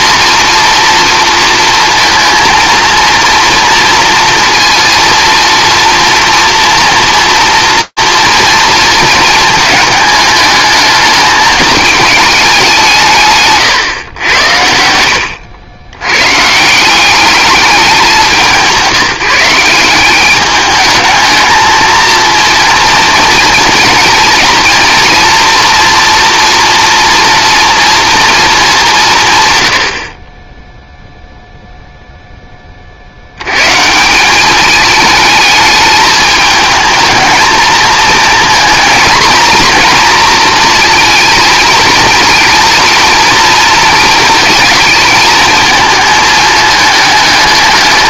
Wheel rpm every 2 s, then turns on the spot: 240, 230, 230, 230, 230, 220, 220, 110, 110, 190, 200, 230, 230, 230, 230, 40, 20, 200, 220, 230, 230, 230, 220, 220.
none